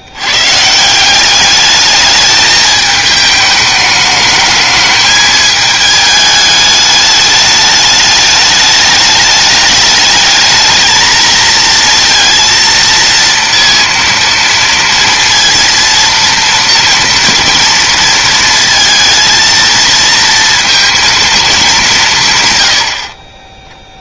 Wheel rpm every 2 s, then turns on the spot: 150, 220, 220, 210, 210, 220, 230, 230, 230, 230, 230, 100.
22-24